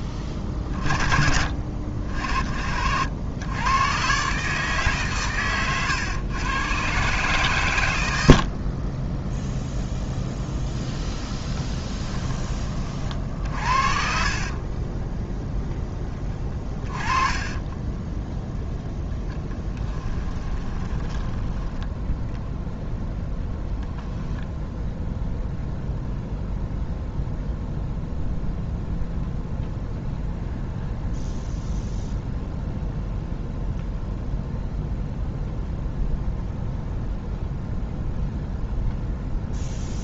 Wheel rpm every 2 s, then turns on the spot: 20, 70, 140, 130, 30, 0, 40, 20, 20, 10, 20, 0, 0, 0, 0, 0, 0, 0, 0, 0.
14-18 20-22